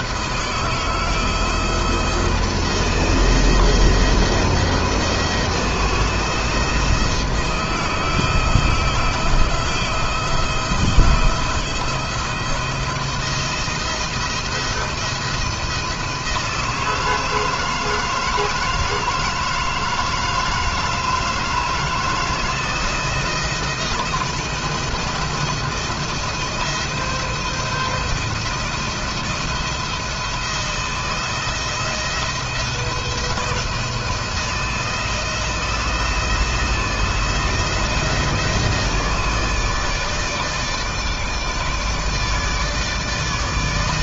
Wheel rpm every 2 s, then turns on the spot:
160, 170, 160, 160, 170, 170, 170, 160, 160, 160, 160, 160, 170, 170, 170, 160, 170, 170, 160, 160, 160, 160.
none